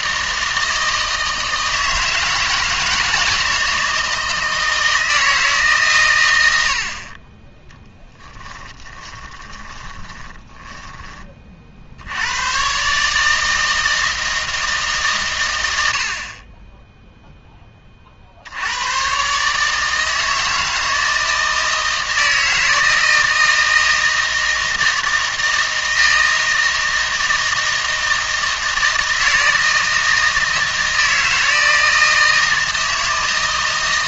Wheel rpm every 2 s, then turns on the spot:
160, 160, 160, 70, 10, 10, 130, 160, 20, 90, 160, 160, 160, 160, 160, 160, 160.
8-12